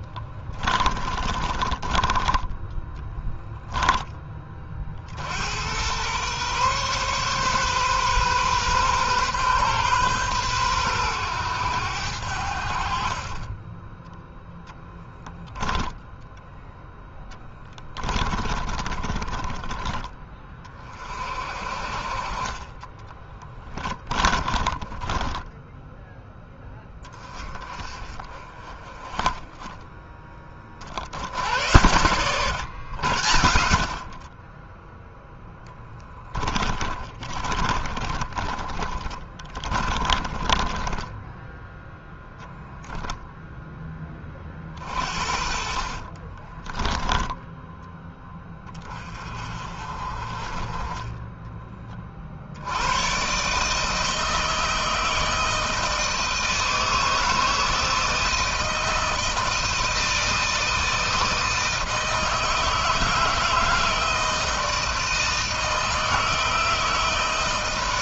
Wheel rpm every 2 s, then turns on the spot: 30, 10, 40, 130, 130, 110, 50, 10, 10, 20, 30, 30, 20, 10, 30, 40, 120, 10, 30, 30, 20, 0, 40, 20, 20, 30, 90, 160, 160, 160, 160, 160, 160, 160.
0-4 22-26 36-40